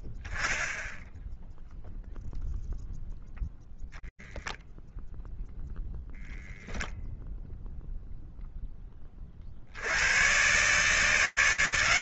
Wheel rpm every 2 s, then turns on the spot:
0, 0, 10, 10, 20, 140.
none